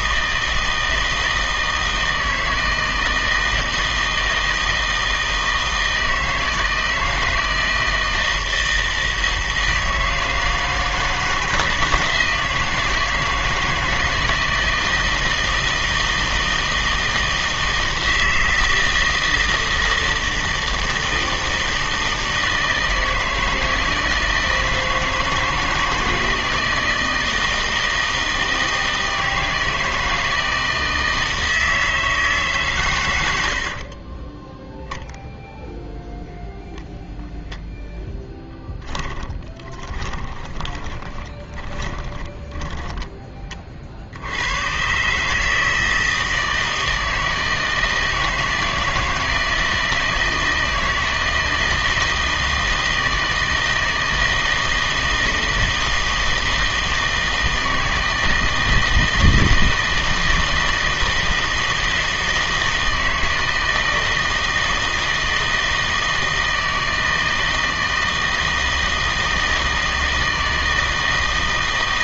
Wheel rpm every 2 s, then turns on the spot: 160, 160, 160, 160, 160, 160, 160, 160, 160, 160, 160, 160, 160, 160, 160, 160, 140, 0, 10, 10, 20, 10, 100, 160, 160, 160, 160, 160, 160, 160, 160, 160, 160, 160, 160, 160.
38-44